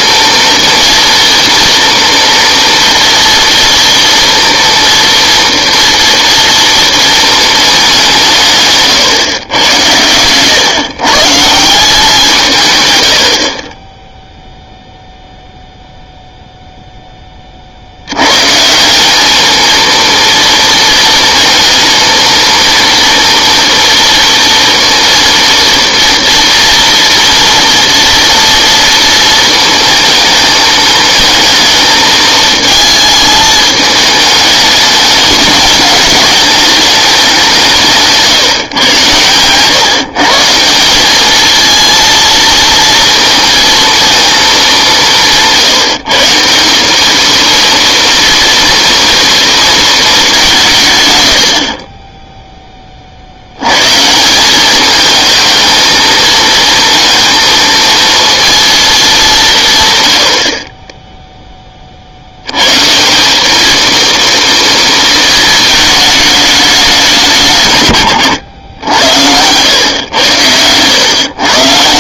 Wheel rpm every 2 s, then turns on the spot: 230, 230, 230, 230, 140, 130, 150, 0, 0, 160, 230, 230, 230, 230, 230, 220, 220, 220, 210, 140, 180, 230, 210, 180, 230, 160, 10, 200, 220, 230, 40, 120, 230, 210, 110, 100.
none